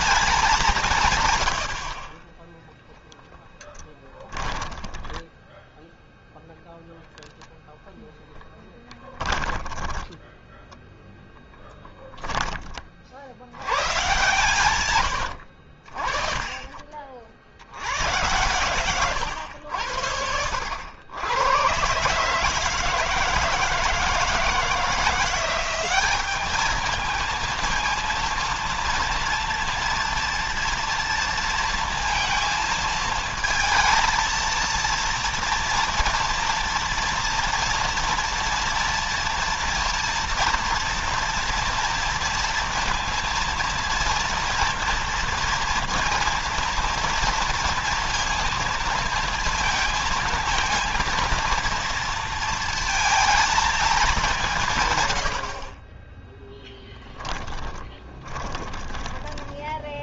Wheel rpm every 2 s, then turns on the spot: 180, 0, 20, 0, 10, 10, 20, 100, 30, 120, 80, 150, 160, 210, 230, 230, 230, 230, 230, 230, 230, 230, 230, 230, 230, 230, 230, 150, 10, 20.
4-6 8-12 14-16 58-60